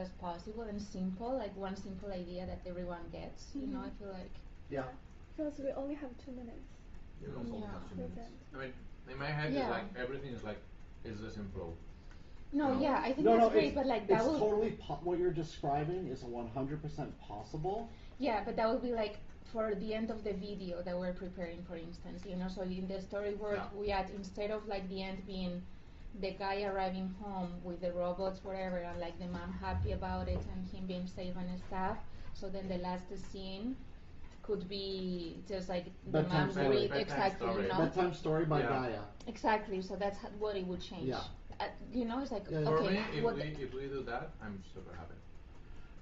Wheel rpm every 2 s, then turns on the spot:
0, 0, 0, 0, 0, 0, 0, 0, 0, 0, 0, 0, 0, 0, 0, 0, 0, 0, 0, 0, 0, 0, 0.
none